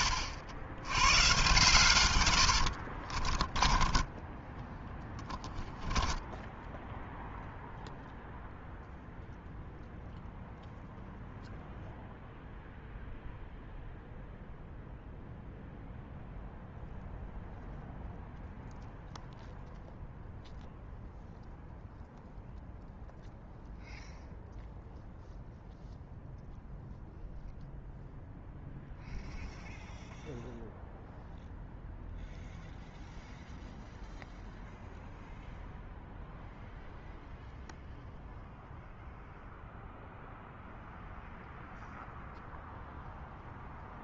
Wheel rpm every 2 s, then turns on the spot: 80, 90, 10, 0, 0, 0, 0, 0, 0, 0, 0, 0, 0, 0, 0, 0, 0, 0, 0, 0, 0, 0.
none